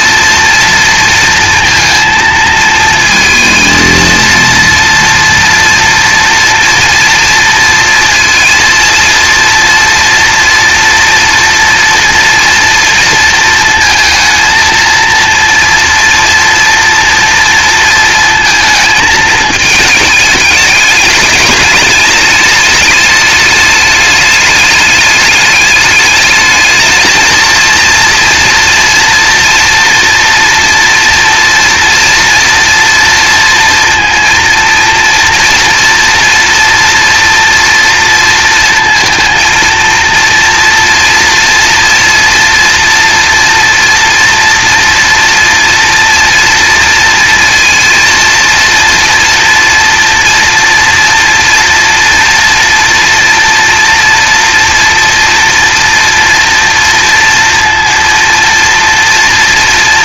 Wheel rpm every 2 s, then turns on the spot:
230, 230, 230, 230, 230, 240, 230, 230, 230, 220, 210, 210, 210, 220, 240, 230, 230, 230, 240, 230, 240, 230, 230, 230, 230, 240, 230, 230, 230, 240.
none